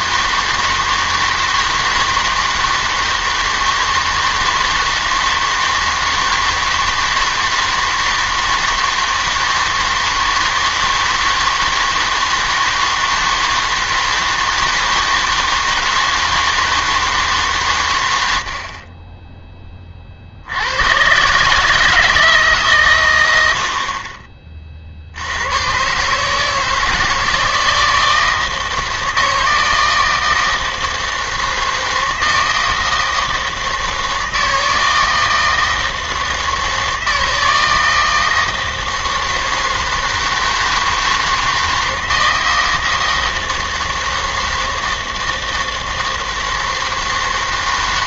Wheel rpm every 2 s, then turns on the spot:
160, 160, 160, 160, 160, 160, 160, 160, 160, 40, 90, 130, 40, 160, 160, 160, 160, 160, 160, 160, 160, 160, 160, 160.
none